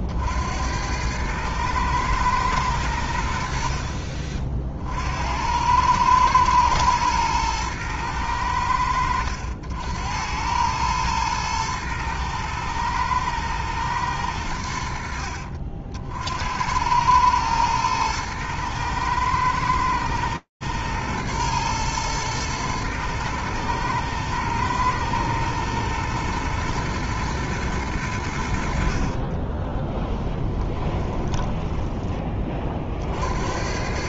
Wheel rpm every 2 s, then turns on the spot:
90, 100, 50, 110, 90, 100, 110, 90, 90, 110, 110, 110, 110, 120, 50, 20, 60.
28-32